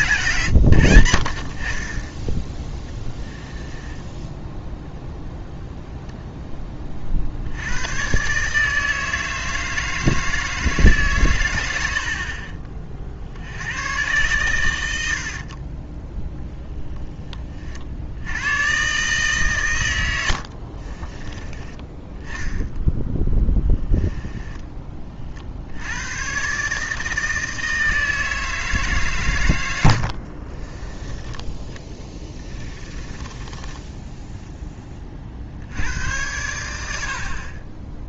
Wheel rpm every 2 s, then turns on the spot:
110, 10, 0, 20, 150, 160, 40, 100, 10, 120, 50, 0, 20, 140, 160, 30, 20, 10, 90.
12-14 20-22 30-34